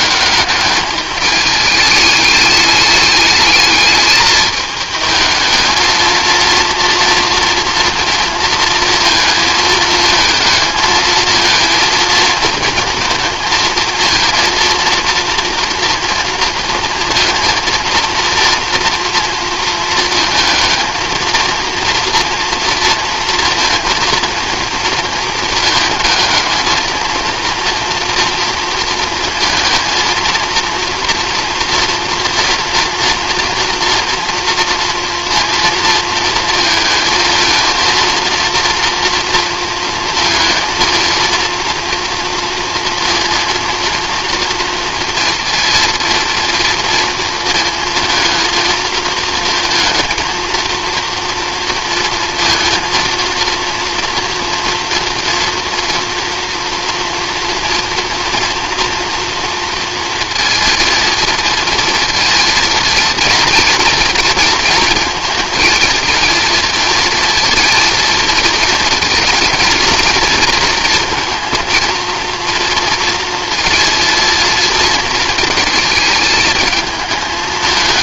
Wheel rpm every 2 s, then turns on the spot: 210, 210, 210, 230, 230, 220, 230, 240, 230, 240, 230, 230, 230, 220, 230, 230, 230, 240, 220, 230, 220, 230, 230, 230, 220, 230, 230, 230, 230, 230, 230, 220, 220, 220, 230, 230, 230, 220, 210.
none